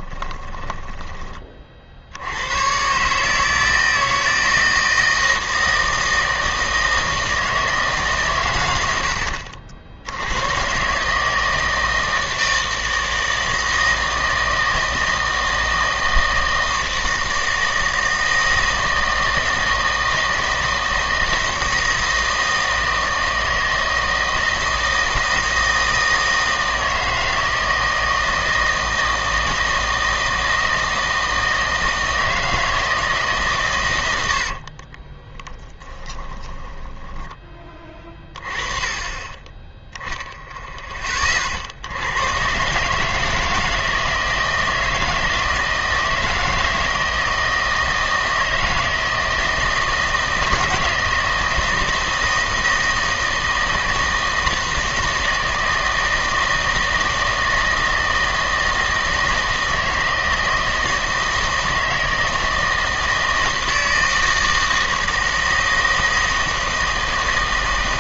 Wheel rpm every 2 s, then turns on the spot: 20, 110, 160, 160, 100, 120, 160, 160, 160, 160, 160, 160, 160, 160, 160, 160, 160, 50, 20, 20, 10, 150, 160, 160, 160, 160, 160, 160, 160, 160, 160, 160, 160, 160.
0-2 34-38